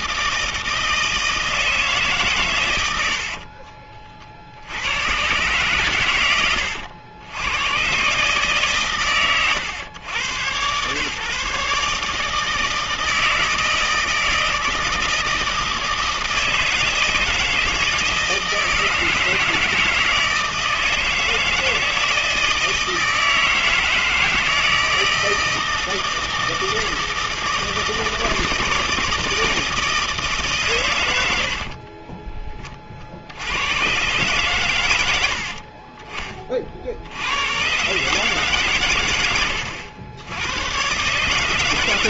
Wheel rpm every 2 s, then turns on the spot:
160, 110, 70, 100, 140, 120, 160, 160, 160, 160, 160, 160, 160, 160, 160, 140, 20, 110, 40, 130, 110.
none